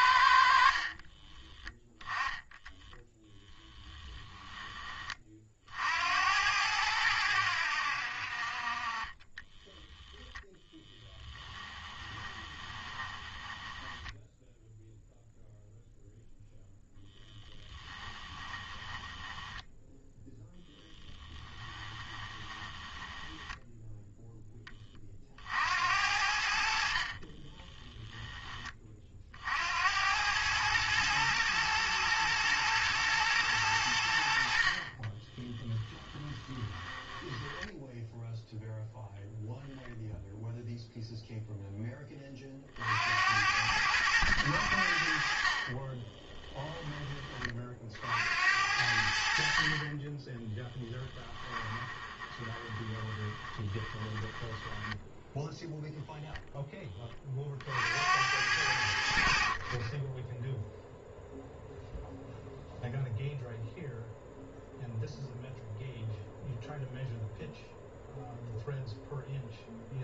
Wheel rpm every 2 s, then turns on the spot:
40, 20, 30, 90, 30, 10, 20, 0, 10, 20, 10, 10, 30, 50, 30, 110, 120, 40, 10, 0, 0, 70, 60, 20, 70, 10, 20, 10, 20, 80, 0, 0, 0, 0, 0.
0-2 10-14 18-20 22-24 26-28 34-38 50-56